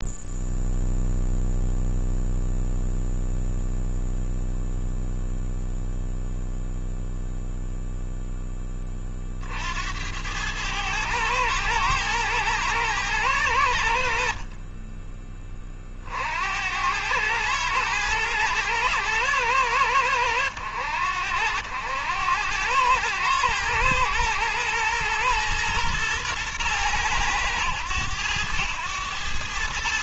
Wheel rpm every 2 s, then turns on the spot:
0, 0, 0, 0, 20, 100, 110, 30, 80, 110, 80, 100, 120, 110, 100.
none